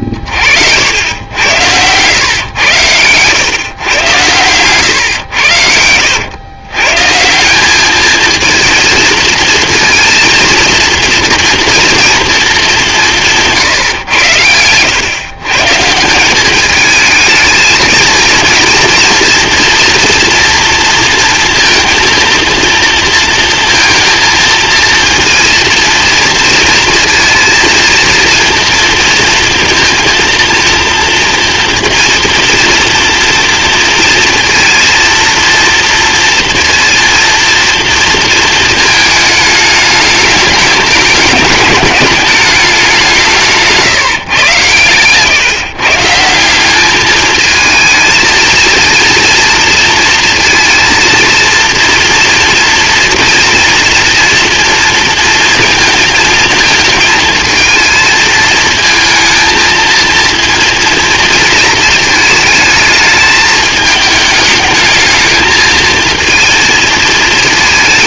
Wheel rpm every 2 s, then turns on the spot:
60, 110, 120, 120, 230, 230, 210, 110, 200, 230, 230, 230, 230, 230, 230, 230, 230, 230, 230, 220, 210, 200, 130, 200, 230, 230, 230, 230, 220, 220, 230, 220, 210, 230.
none